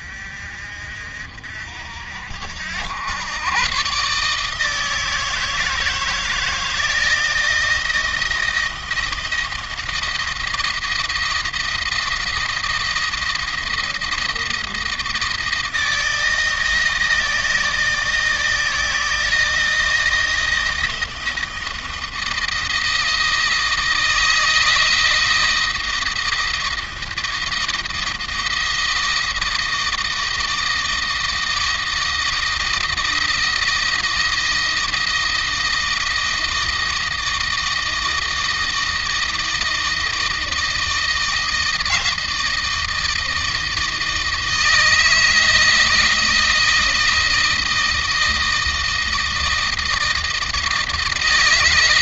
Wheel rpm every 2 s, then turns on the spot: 50, 80, 150, 160, 170, 160, 160, 160, 160, 160, 160, 160, 160, 160, 170, 160, 160, 170, 160, 160, 160, 160, 160, 160, 160, 160.
none